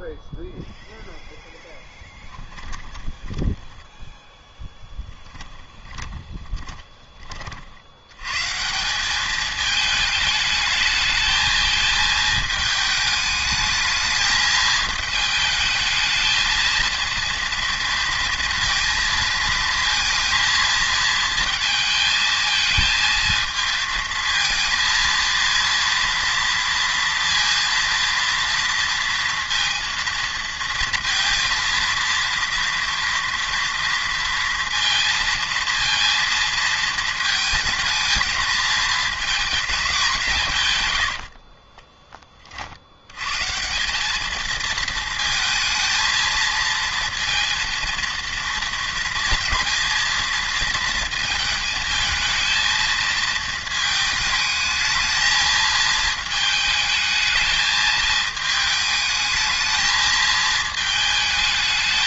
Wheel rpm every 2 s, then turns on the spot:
0, 10, 10, 20, 160, 210, 220, 220, 230, 230, 230, 220, 230, 230, 230, 230, 230, 230, 230, 220, 130, 60, 220, 230, 230, 230, 220, 220, 220, 220, 220.
2-4 6-8